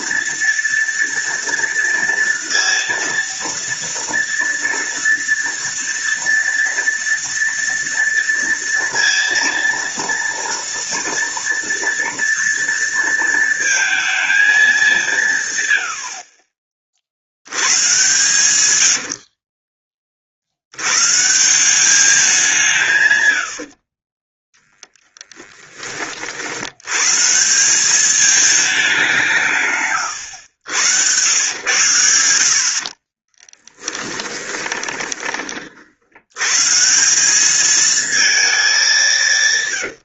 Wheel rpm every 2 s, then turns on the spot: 230, 230, 230, 230, 230, 230, 230, 190, 50, 80, 100, 150, 10, 110, 200, 100, 50, 20, 170, 200.
32-36